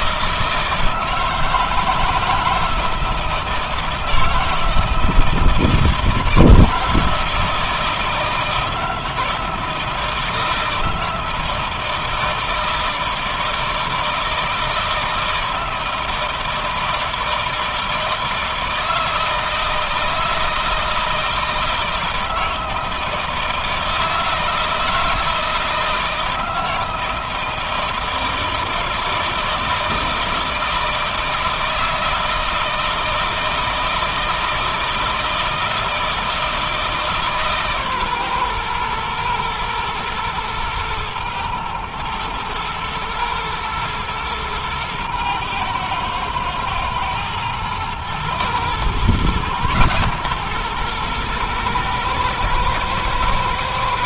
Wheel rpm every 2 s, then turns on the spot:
160, 160, 160, 160, 160, 160, 160, 160, 160, 160, 160, 160, 160, 160, 160, 160, 160, 160, 160, 120, 110, 110, 120, 110, 120, 120, 110.
none